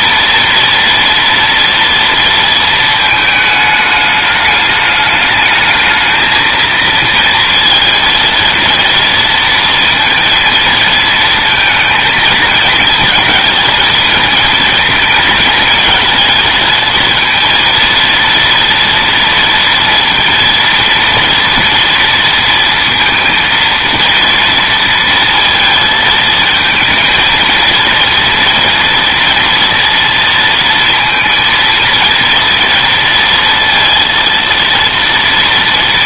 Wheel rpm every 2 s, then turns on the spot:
230, 220, 210, 230, 230, 230, 220, 220, 220, 230, 230, 230, 230, 220, 230, 230, 230, 230.
none